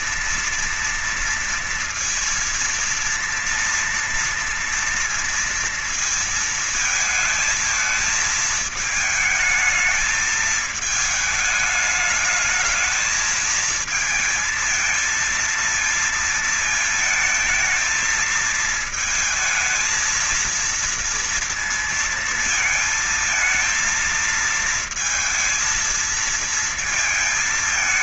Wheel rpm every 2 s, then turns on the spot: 240, 230, 230, 230, 220, 220, 220, 220, 230, 220, 220, 230, 230, 220.
none